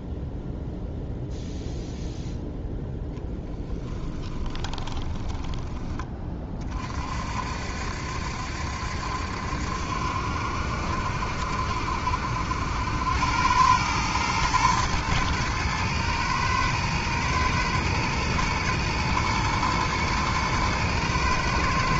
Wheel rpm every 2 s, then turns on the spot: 0, 0, 10, 40, 70, 70, 80, 110, 110, 110, 110.
4-6